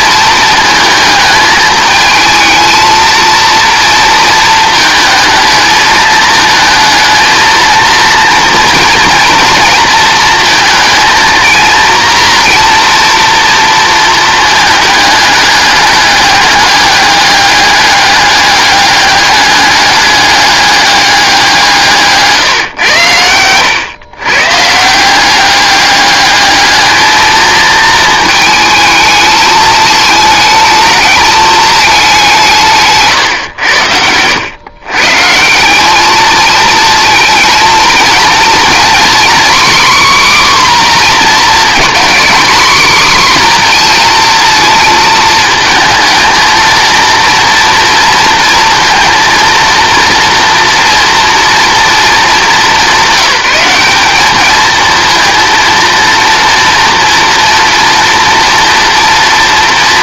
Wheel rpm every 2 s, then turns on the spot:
230, 230, 220, 220, 240, 230, 240, 210, 200, 200, 210, 130, 150, 210, 220, 220, 160, 120, 220, 240, 260, 250, 230, 220, 230, 230, 200, 220, 230, 230.
none